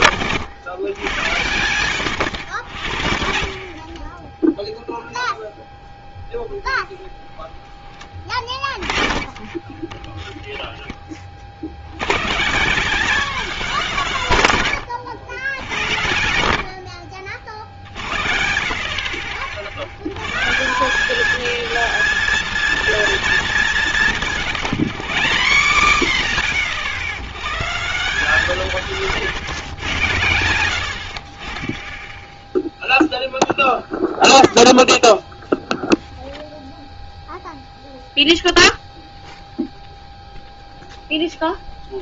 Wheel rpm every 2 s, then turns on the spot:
100, 90, 0, 10, 20, 10, 180, 130, 70, 60, 160, 230, 130, 70, 160, 90, 0, 0, 0, 0, 0.
6-8 10-12 24-28